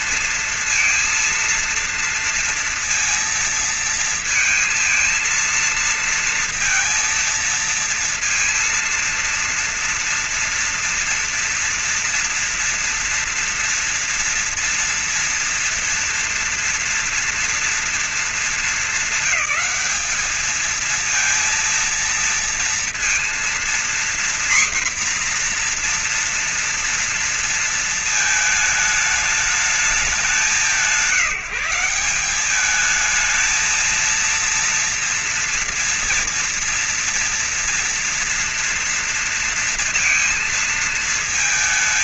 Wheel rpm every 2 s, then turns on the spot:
230, 230, 230, 230, 230, 230, 240, 230, 230, 220, 220, 230, 250, 240, 220, 180, 190, 230, 230, 230, 230.
none